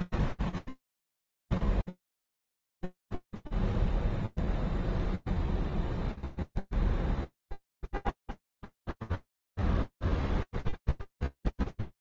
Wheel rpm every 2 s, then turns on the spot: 0, 0, 0, 0, 0, 0.
none